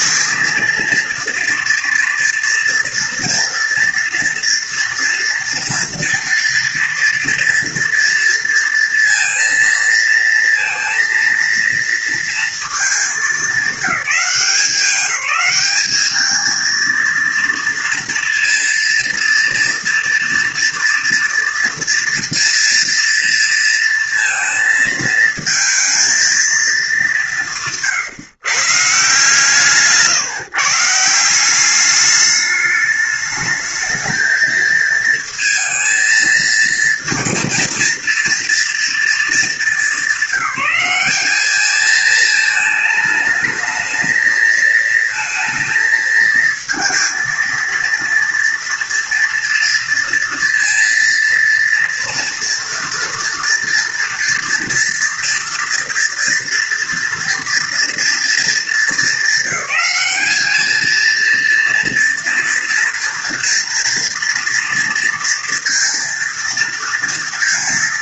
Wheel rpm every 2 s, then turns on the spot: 230, 230, 230, 230, 230, 230, 230, 200, 220, 230, 230, 230, 220, 230, 130, 130, 210, 220, 230, 230, 210, 220, 220, 230, 230, 230, 230, 230, 230, 230, 210, 230, 230, 230.
none